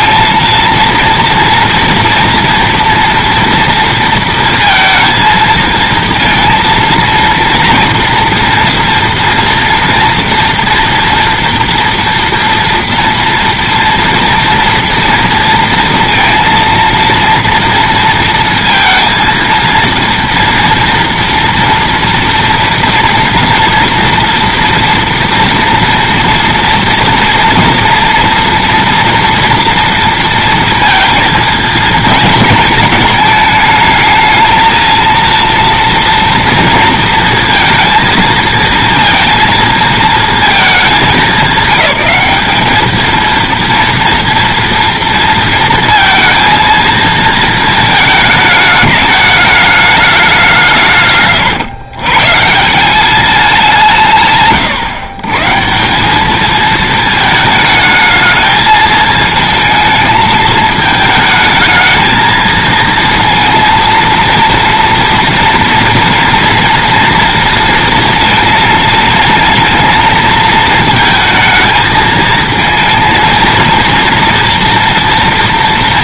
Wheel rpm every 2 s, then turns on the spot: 220, 230, 230, 230, 230, 230, 230, 230, 230, 230, 230, 230, 230, 230, 230, 230, 230, 220, 230, 230, 220, 210, 230, 230, 220, 190, 160, 140, 220, 220, 220, 220, 230, 230, 230, 220, 220, 230.
none